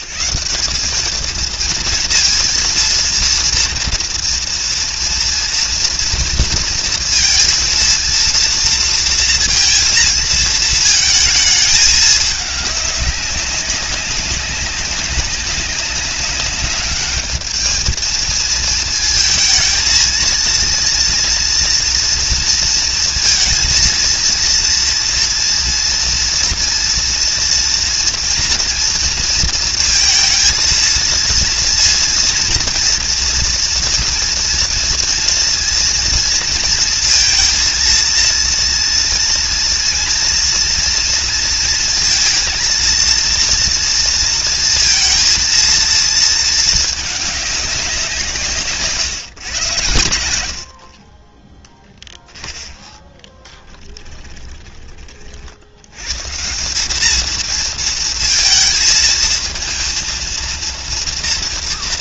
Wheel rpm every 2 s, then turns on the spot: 200, 230, 230, 230, 230, 220, 200, 200, 210, 220, 230, 230, 230, 230, 230, 230, 230, 230, 230, 230, 230, 230, 230, 220, 150, 60, 10, 30, 190, 230, 230.
none